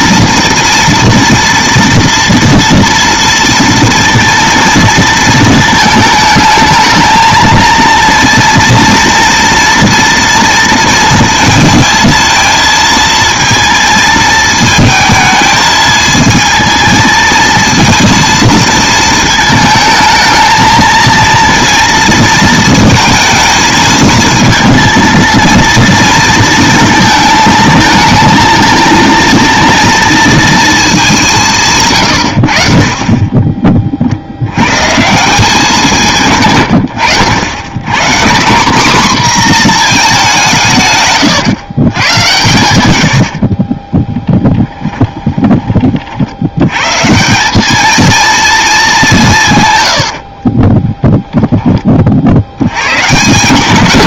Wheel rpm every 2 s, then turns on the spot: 240, 230, 230, 220, 230, 230, 230, 220, 220, 230, 230, 230, 230, 220, 230, 220, 50, 110, 100, 230, 150, 90, 10, 120, 210, 20, 110.
44-46 50-52